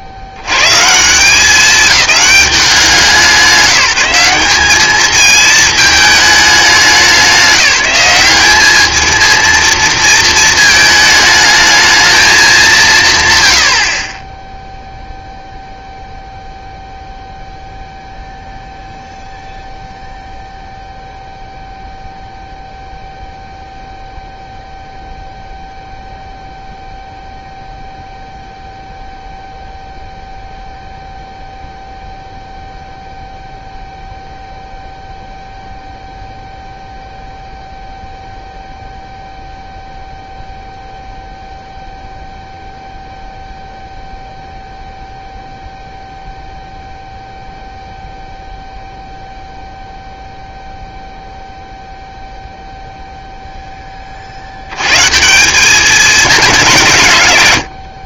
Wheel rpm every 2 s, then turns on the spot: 120, 190, 210, 210, 210, 220, 200, 10, 0, 0, 0, 0, 0, 0, 0, 0, 0, 0, 0, 0, 0, 0, 0, 0, 0, 0, 0, 90, 180.
none